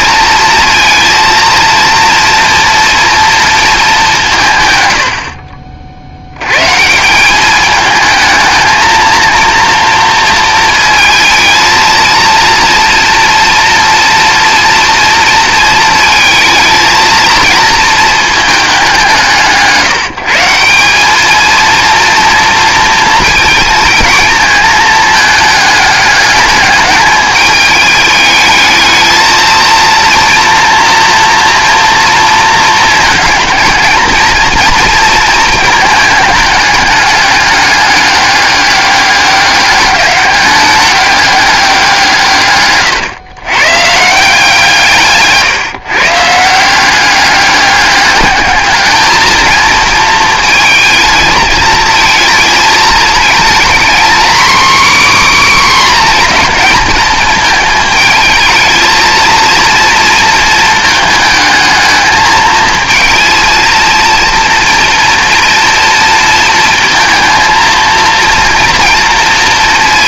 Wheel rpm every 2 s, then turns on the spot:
230, 230, 110, 140, 220, 230, 230, 240, 230, 200, 190, 230, 220, 210, 220, 230, 230, 230, 210, 200, 200, 130, 150, 180, 220, 220, 220, 270, 220, 220, 230, 230, 230, 230, 230.
42-44